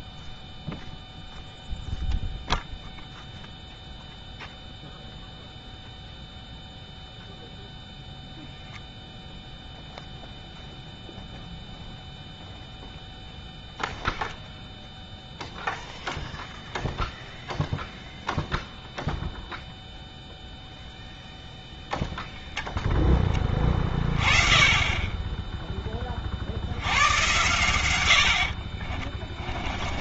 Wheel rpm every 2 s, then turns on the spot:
0, 0, 0, 0, 0, 0, 0, 0, 0, 0, 0, 0, 20, 70, 50.
28-30